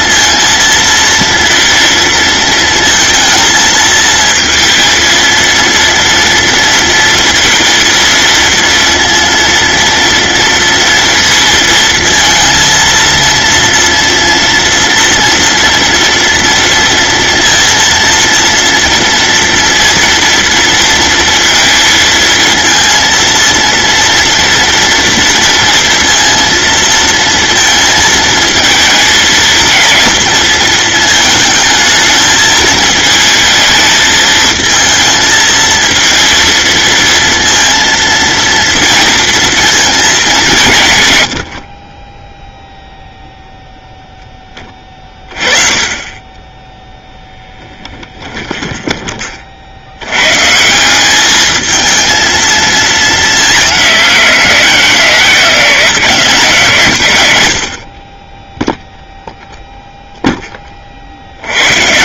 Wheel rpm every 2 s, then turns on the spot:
230, 230, 230, 230, 230, 230, 230, 230, 230, 230, 230, 230, 240, 230, 220, 220, 220, 220, 230, 230, 170, 0, 20, 10, 20, 170, 220, 180, 130, 0, 30.
48-50